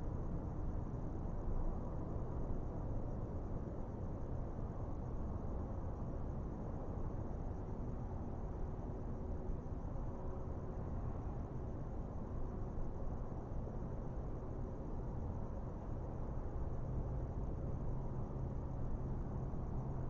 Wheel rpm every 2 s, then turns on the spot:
0, 0, 0, 0, 0, 0, 0, 0, 0, 0.
none